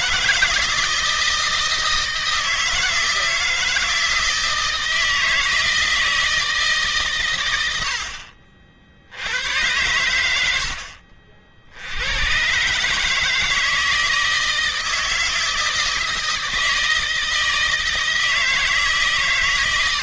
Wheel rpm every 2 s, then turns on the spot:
160, 160, 160, 130, 70, 70, 140, 160, 160, 150.
10-12